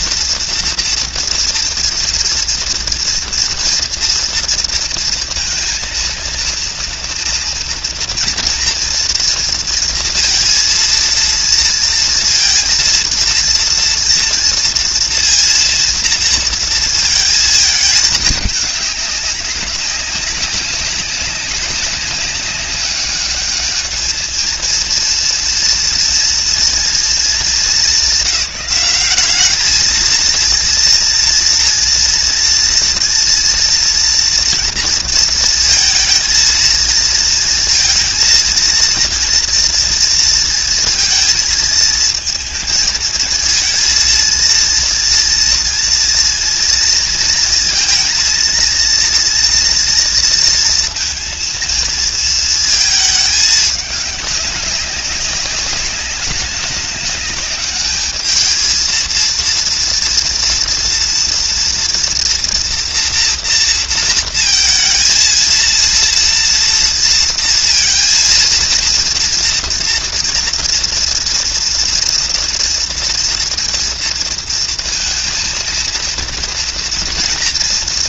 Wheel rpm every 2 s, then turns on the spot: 230, 230, 230, 230, 230, 230, 230, 240, 230, 210, 200, 200, 220, 240, 200, 230, 230, 230, 230, 230, 230, 220, 230, 230, 230, 230, 230, 200, 200, 220, 230, 240, 230, 230, 230, 230, 240, 230, 230.
none